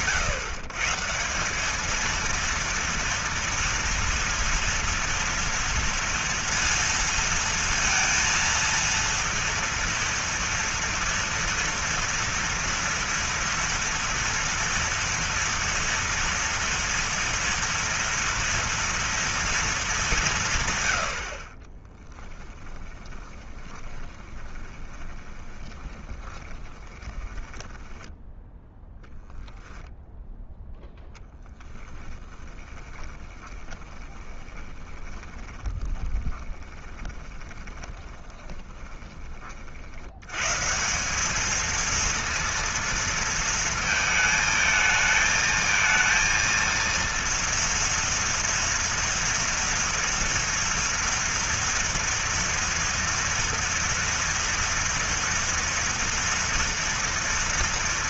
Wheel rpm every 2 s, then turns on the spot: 140, 230, 230, 230, 230, 230, 230, 230, 230, 230, 110, 20, 20, 20, 0, 0, 20, 20, 20, 20, 150, 230, 220, 230, 230, 230, 230, 230, 230.
22-28 32-40